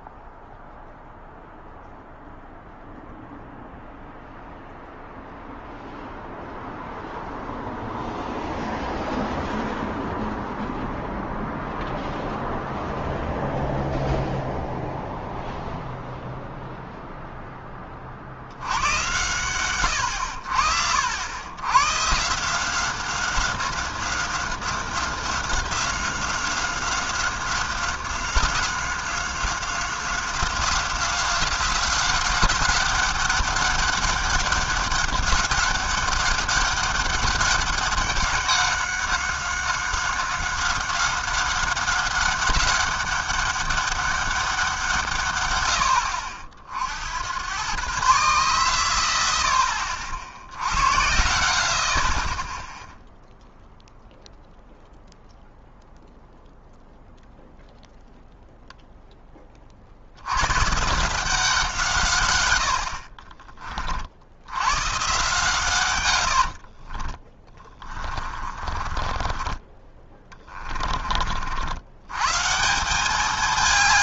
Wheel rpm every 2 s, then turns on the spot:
0, 0, 0, 0, 0, 0, 0, 0, 0, 90, 70, 170, 190, 190, 190, 190, 190, 200, 200, 190, 190, 190, 180, 60, 120, 80, 10, 0, 0, 0, 130, 90, 100, 50, 30, 20, 170.
66-72